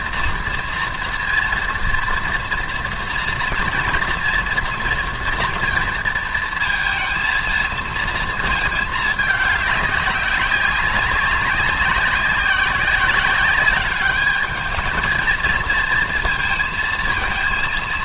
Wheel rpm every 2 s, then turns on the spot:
230, 240, 230, 230, 220, 190, 190, 210, 220.
none